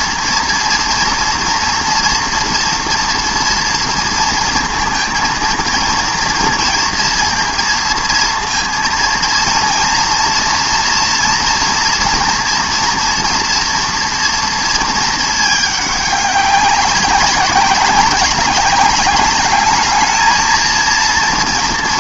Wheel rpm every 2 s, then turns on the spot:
230, 240, 230, 230, 230, 230, 230, 230, 200, 200, 230.
none